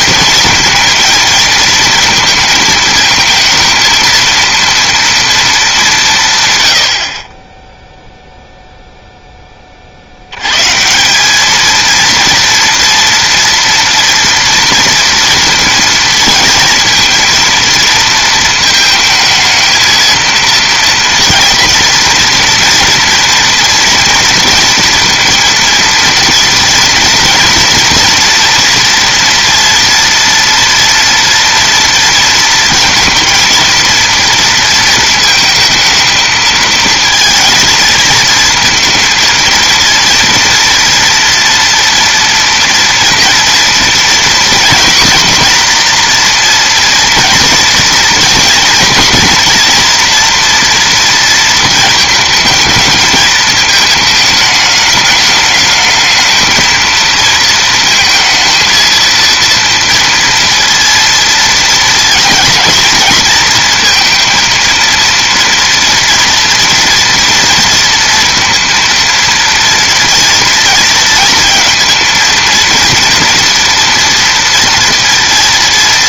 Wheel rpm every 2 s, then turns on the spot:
220, 220, 230, 120, 0, 150, 230, 230, 230, 220, 230, 230, 230, 240, 230, 230, 230, 230, 220, 220, 240, 230, 240, 230, 230, 230, 220, 210, 230, 230, 230, 230, 230, 230, 230, 230, 230, 230.
none